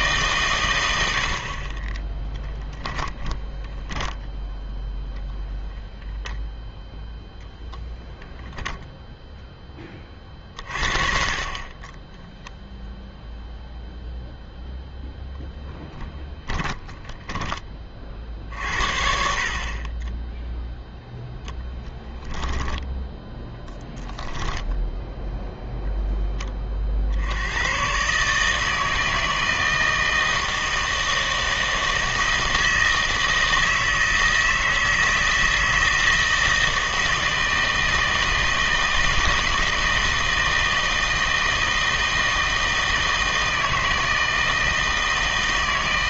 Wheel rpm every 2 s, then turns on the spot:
110, 10, 10, 0, 10, 40, 0, 0, 10, 60, 0, 10, 0, 40, 160, 160, 160, 160, 160, 160, 160, 160, 160.
2-4 16-18 22-24